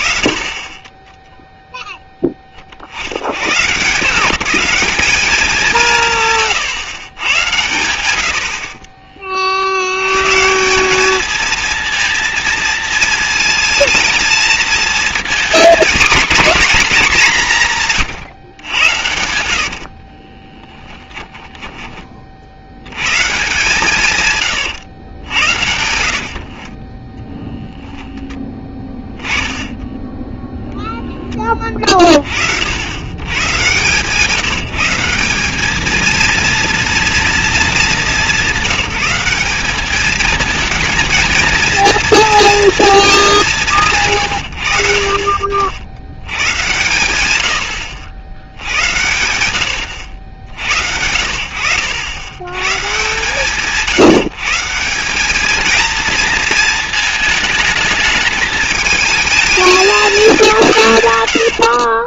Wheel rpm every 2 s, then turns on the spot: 10, 100, 200, 110, 30, 210, 230, 230, 200, 80, 20, 110, 100, 20, 10, 0, 90, 180, 230, 200, 220, 230, 60, 100, 90, 80, 130, 160, 220, 220, 170.
20-22 24-26